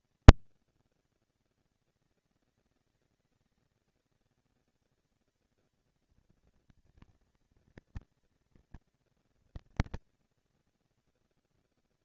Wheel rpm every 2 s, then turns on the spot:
210, 200, 210, 230, 230, 230.
none